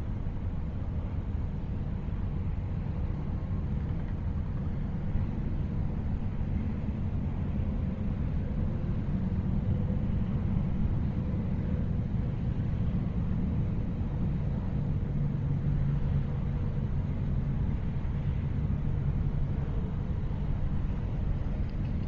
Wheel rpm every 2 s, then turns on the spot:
0, 0, 0, 0, 0, 0, 0, 0, 0, 0, 0.
none